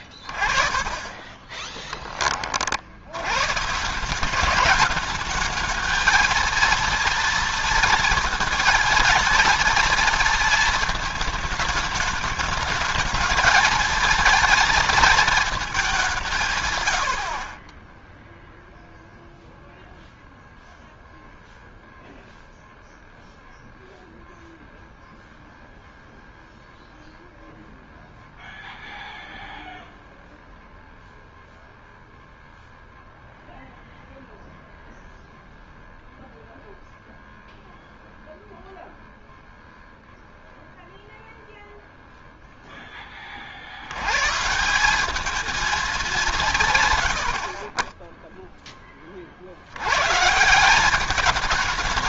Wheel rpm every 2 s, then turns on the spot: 30, 40, 190, 230, 230, 230, 210, 230, 140, 0, 0, 0, 0, 0, 0, 0, 0, 0, 0, 0, 0, 0, 150, 160, 10, 170.
0-2